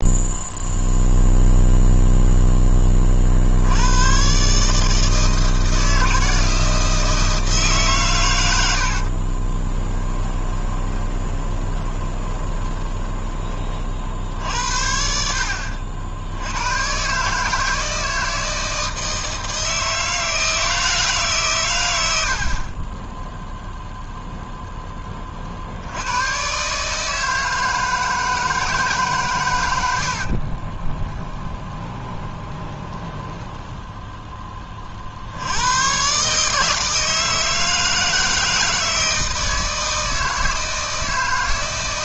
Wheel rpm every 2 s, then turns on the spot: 0, 30, 160, 160, 60, 20, 20, 60, 130, 160, 150, 20, 20, 150, 140, 20, 20, 40, 160, 160, 160.
8-14 30-34